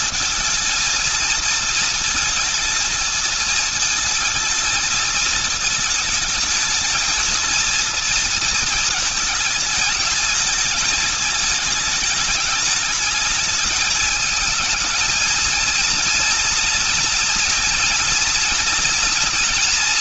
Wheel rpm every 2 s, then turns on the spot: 230, 230, 220, 220, 230, 220, 210, 220, 230, 220.
none